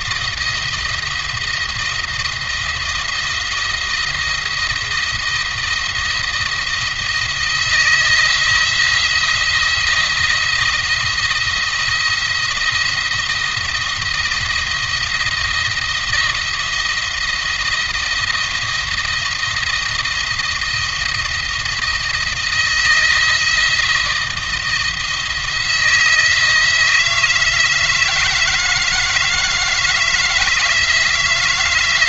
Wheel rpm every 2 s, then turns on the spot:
170, 170, 170, 160, 160, 170, 170, 170, 170, 170, 170, 170, 170, 160, 160, 160.
none